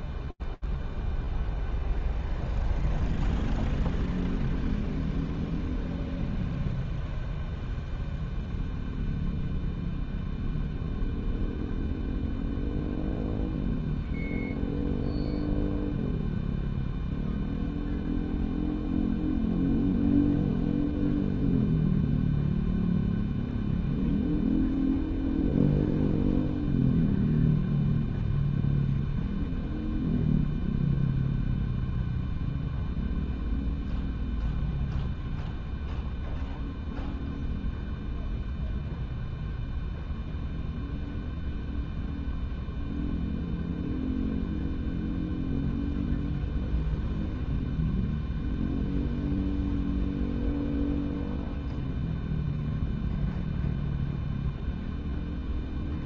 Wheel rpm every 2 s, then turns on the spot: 0, 0, 0, 0, 0, 0, 0, 0, 0, 0, 0, 0, 0, 0, 0, 0, 0, 0, 0, 0, 0, 0, 0, 0, 0, 0, 0, 0.
none